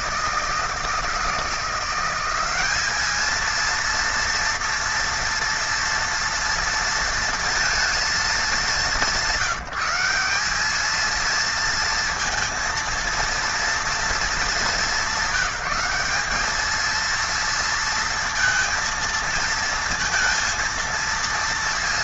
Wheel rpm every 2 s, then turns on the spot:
160, 190, 230, 230, 210, 190, 230, 220, 210, 230, 230.
none